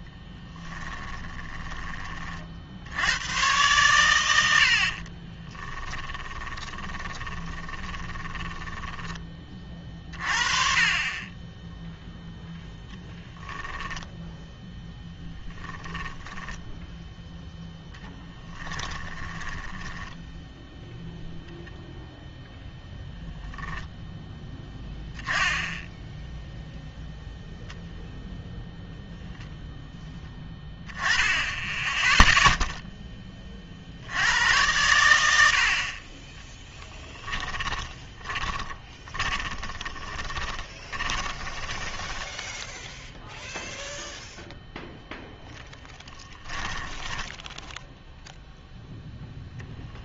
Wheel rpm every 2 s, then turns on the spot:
20, 60, 70, 20, 20, 30, 10, 0, 10, 10, 0, 0, 10, 0, 0, 10, 0, 90, 10, 20, 20, 0, 0, 10, 0.
0-2 6-10 16-20 36-42 46-48